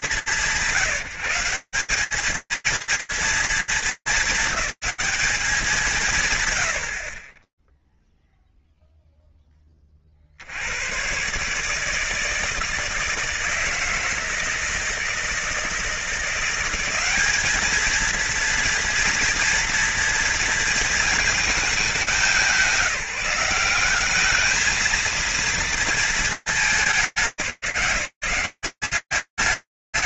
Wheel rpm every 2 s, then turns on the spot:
200, 190, 220, 180, 0, 70, 160, 160, 170, 230, 230, 190, 210, 220, 160.
none